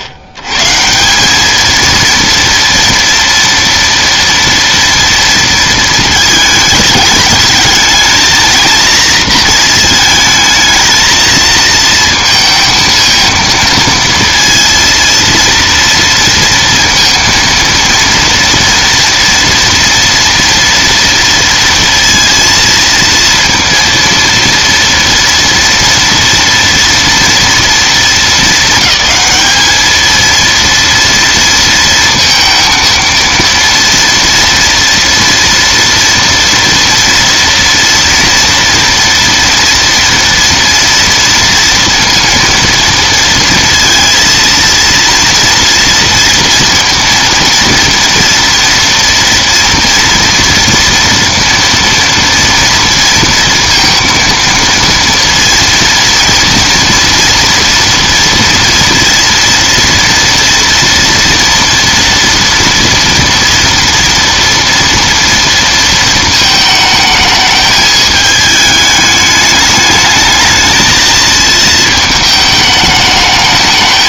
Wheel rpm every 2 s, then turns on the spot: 100, 230, 230, 210, 230, 220, 230, 230, 230, 230, 230, 230, 230, 240, 210, 230, 230, 230, 230, 230, 230, 230, 230, 230, 230, 230, 230, 230, 230, 230, 230, 230, 230, 220, 210, 220, 220.
none